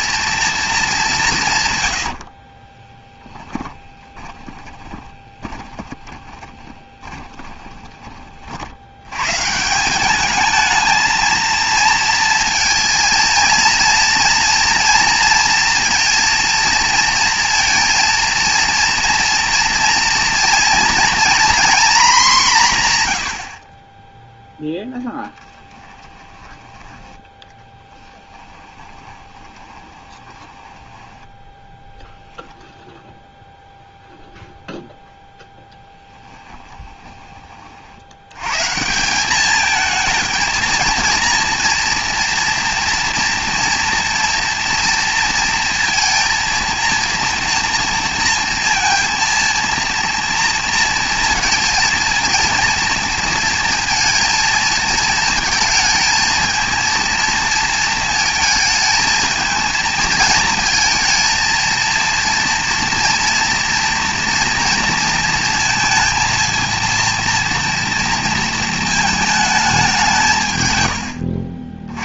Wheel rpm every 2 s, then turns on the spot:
220, 20, 20, 20, 70, 220, 230, 230, 230, 230, 230, 160, 0, 10, 20, 10, 0, 0, 20, 150, 230, 240, 230, 230, 230, 230, 230, 230, 230, 220, 220, 240, 230, 230, 220, 120.
2-8 28-32 36-38